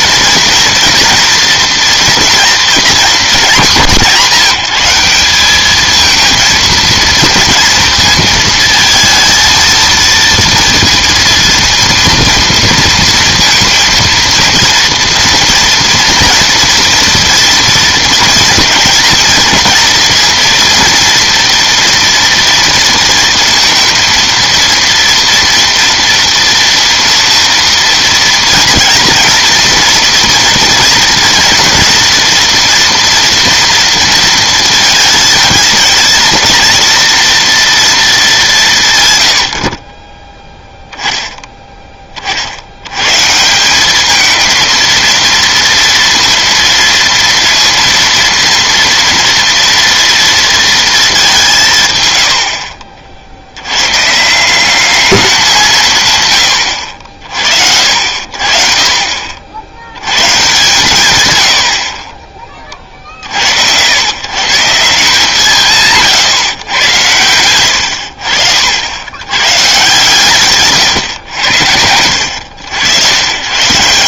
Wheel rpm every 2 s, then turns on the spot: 230, 230, 190, 220, 220, 230, 230, 240, 240, 230, 230, 230, 230, 230, 230, 230, 240, 230, 230, 170, 10, 70, 220, 230, 230, 230, 60, 200, 100, 50, 130, 40, 170, 130, 70, 130, 90.
none